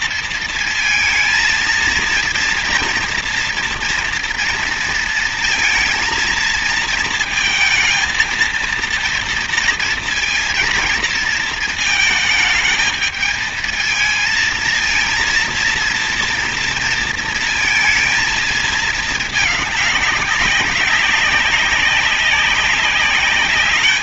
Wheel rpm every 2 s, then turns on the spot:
230, 230, 230, 230, 230, 230, 220, 230, 230, 220, 200, 190.
none